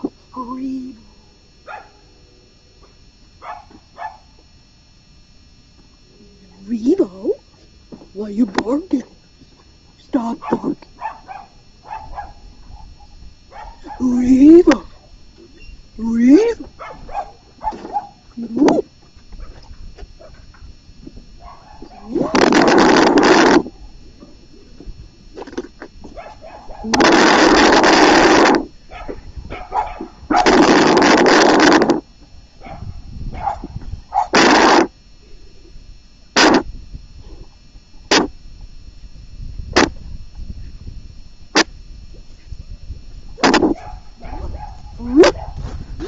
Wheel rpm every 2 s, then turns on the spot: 0, 0, 0, 0, 0, 0, 0, 0, 0, 0, 0, 0, 0, 0, 0, 0, 0, 0, 0, 0, 0, 0, 0.
none